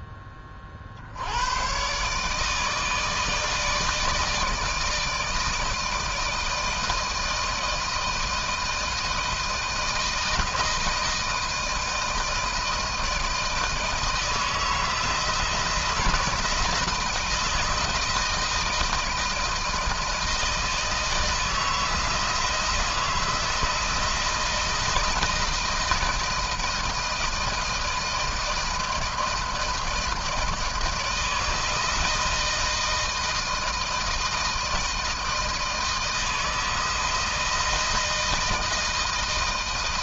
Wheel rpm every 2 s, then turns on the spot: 30, 150, 160, 160, 160, 160, 160, 160, 170, 160, 160, 160, 170, 160, 160, 160, 160, 160, 160, 160.
none